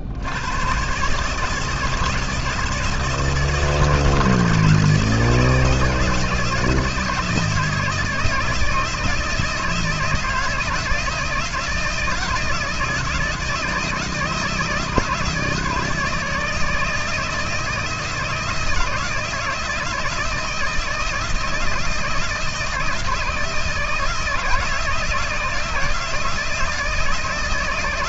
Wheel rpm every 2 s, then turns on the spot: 110, 160, 160, 160, 160, 160, 160, 160, 160, 160, 160, 160, 160, 160.
none